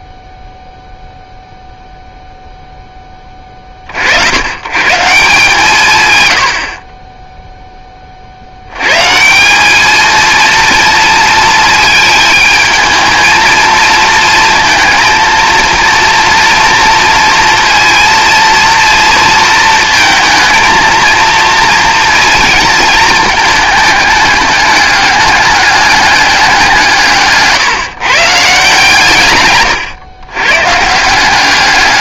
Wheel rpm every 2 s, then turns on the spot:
0, 10, 130, 40, 120, 230, 220, 230, 230, 230, 230, 220, 200, 180, 140, 140.
none